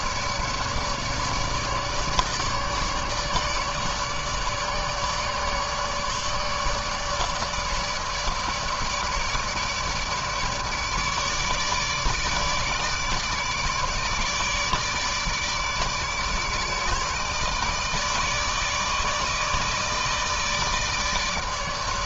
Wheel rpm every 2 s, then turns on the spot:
150, 150, 150, 150, 150, 150, 150, 150, 150, 150, 160.
none